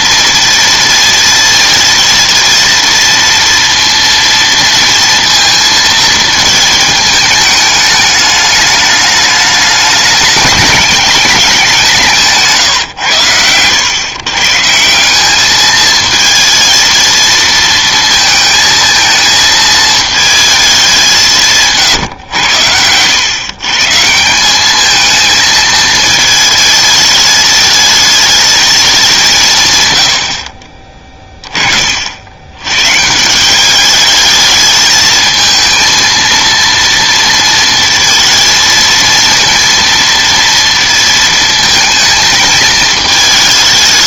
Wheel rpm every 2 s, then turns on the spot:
230, 230, 230, 220, 210, 210, 140, 150, 230, 220, 210, 100, 200, 220, 210, 30, 120, 210, 230, 230, 230, 220.
30-32